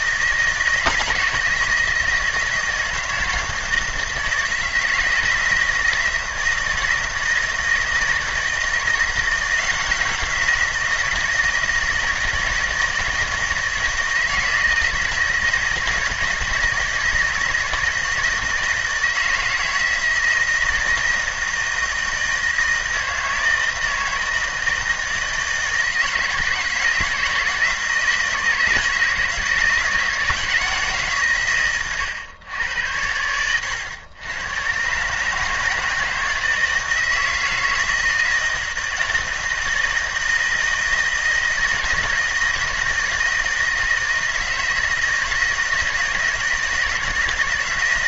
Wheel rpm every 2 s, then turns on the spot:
160, 160, 160, 170, 160, 170, 160, 160, 160, 160, 160, 160, 160, 160, 160, 160, 100, 120, 160, 160, 160, 160, 160, 160.
none